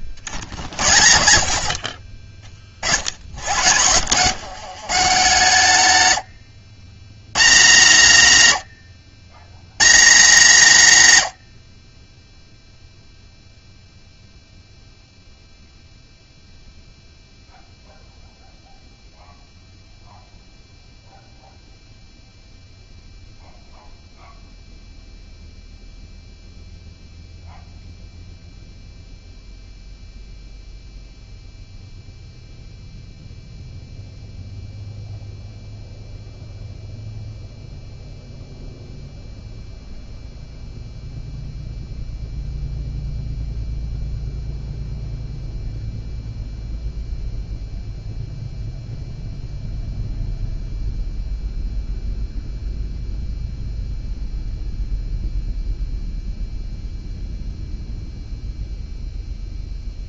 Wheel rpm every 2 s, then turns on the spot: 60, 50, 130, 90, 90, 140, 0, 0, 0, 0, 0, 0, 0, 0, 0, 0, 0, 0, 0, 0, 0, 0, 0, 0, 0, 0, 0, 0, 0, 0.
none